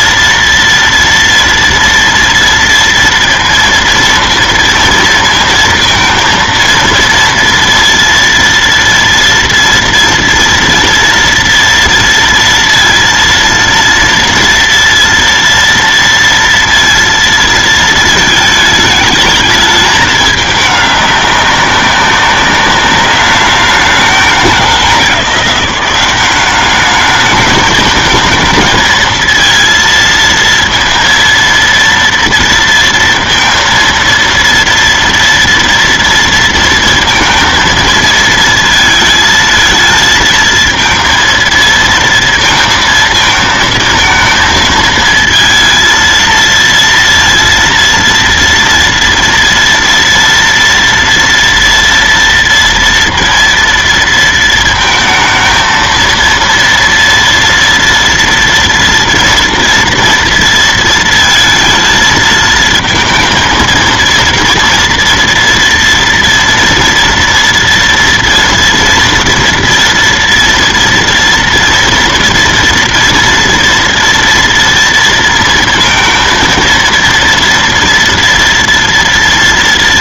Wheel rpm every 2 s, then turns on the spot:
230, 230, 230, 230, 230, 230, 230, 230, 230, 220, 210, 200, 180, 200, 230, 230, 230, 230, 230, 230, 230, 230, 230, 230, 230, 240, 230, 230, 230, 230, 230, 220, 230, 230, 230, 230, 230, 230, 230, 240.
none